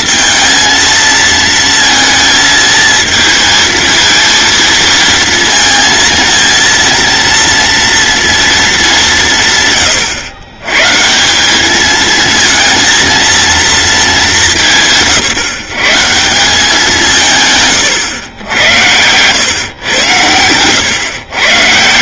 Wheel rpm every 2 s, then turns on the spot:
220, 220, 230, 230, 220, 130, 230, 170, 190, 90, 120.
none